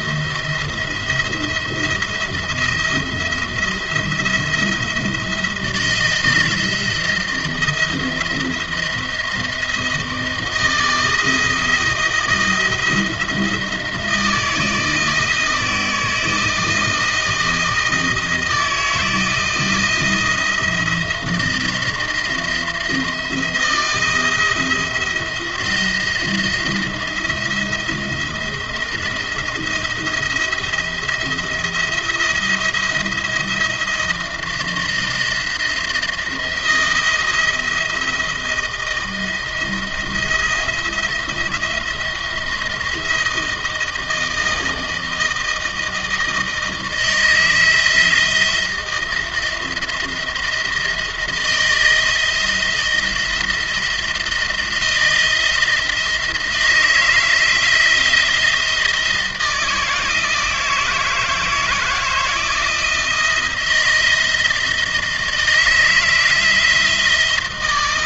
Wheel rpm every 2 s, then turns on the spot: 170, 170, 170, 170, 170, 160, 170, 160, 160, 160, 170, 170, 170, 170, 170, 170, 170, 170, 170, 170, 170, 170, 160, 160, 170, 170, 170, 170, 160, 160, 160, 160, 160, 160.
none